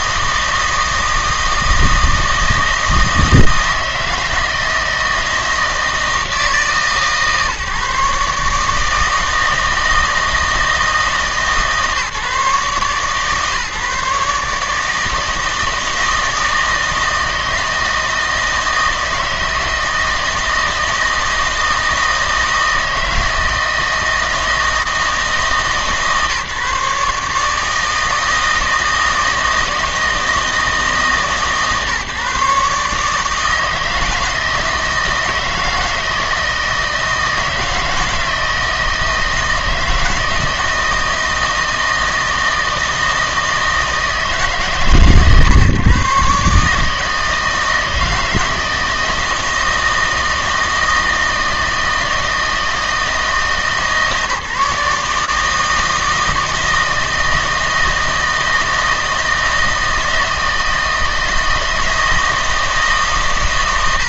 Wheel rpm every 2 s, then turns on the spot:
160, 160, 160, 160, 150, 160, 140, 150, 160, 160, 160, 160, 160, 150, 160, 150, 140, 160, 160, 160, 160, 160, 130, 140, 160, 160, 160, 150, 160, 160, 160, 160.
none